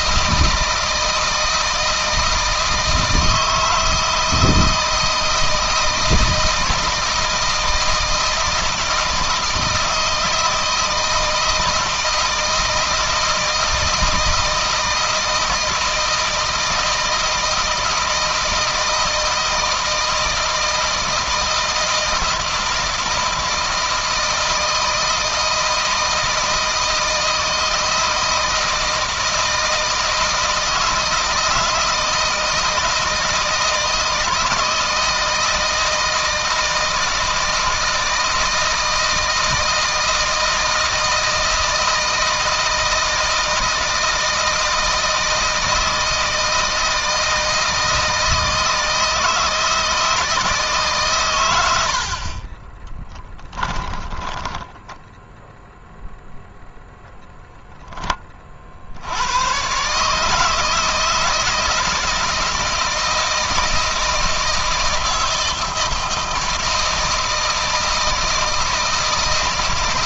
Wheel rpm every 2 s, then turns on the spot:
160, 160, 160, 160, 160, 160, 160, 160, 160, 160, 160, 160, 160, 160, 160, 160, 160, 160, 160, 160, 160, 160, 160, 160, 160, 140, 20, 10, 0, 80, 160, 160, 160, 160, 160.
52-54